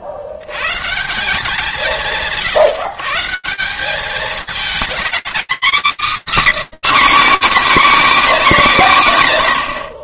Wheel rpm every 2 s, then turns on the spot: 150, 150, 240, 280, 30.
none